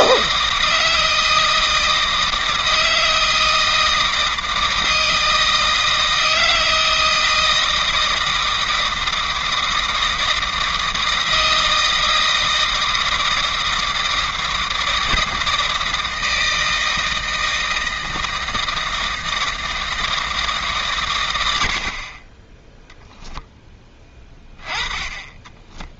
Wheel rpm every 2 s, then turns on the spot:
160, 160, 160, 160, 160, 160, 160, 160, 160, 160, 150, 10, 10.
22-24